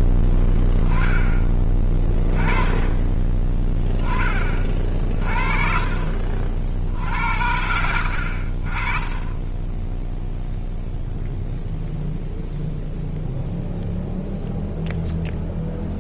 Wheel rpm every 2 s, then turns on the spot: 0, 20, 10, 50, 60, 0, 0, 0.
none